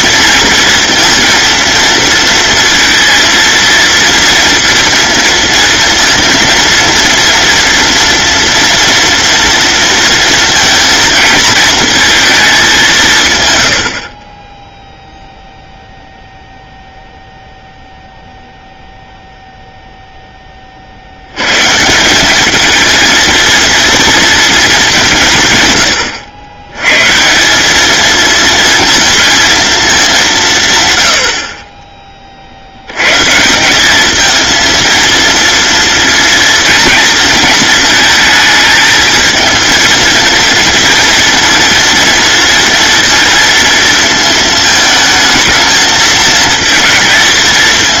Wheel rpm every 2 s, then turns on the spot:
230, 230, 230, 230, 230, 220, 130, 0, 0, 0, 30, 210, 210, 100, 230, 160, 70, 230, 230, 220, 230, 230, 220, 220.
none